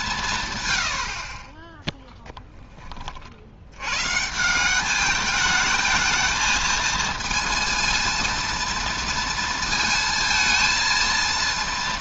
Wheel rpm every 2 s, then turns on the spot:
110, 10, 190, 220, 230, 220.
none